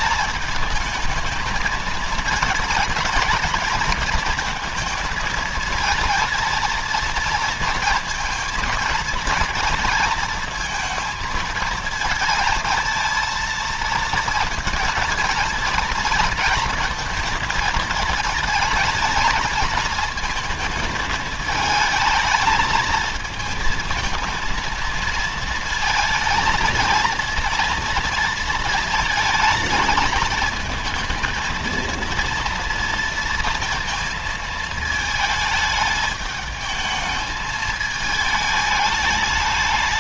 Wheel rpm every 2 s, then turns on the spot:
220, 220, 230, 230, 230, 230, 230, 230, 230, 230, 220, 220, 220, 220, 220, 220, 230, 220, 220, 210.
none